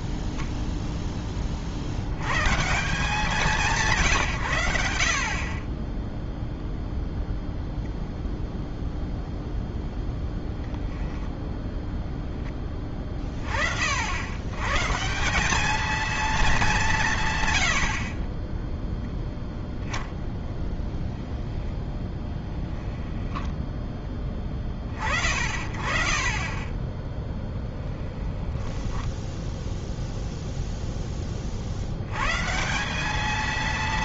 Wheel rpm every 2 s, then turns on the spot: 0, 150, 100, 0, 0, 0, 20, 130, 210, 10, 10, 10, 20, 30, 10, 0, 160.
22-24